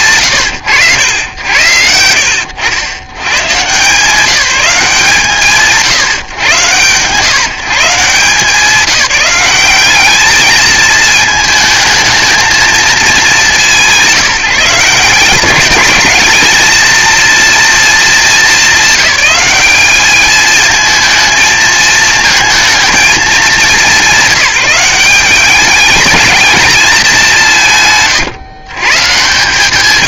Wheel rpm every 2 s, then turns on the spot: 170, 60, 180, 130, 170, 210, 220, 150, 220, 210, 220, 230, 190, 220, 150.
none